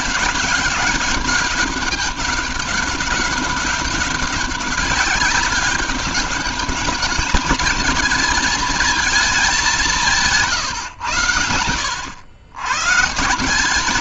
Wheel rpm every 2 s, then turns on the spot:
200, 200, 200, 210, 220, 100, 150.
none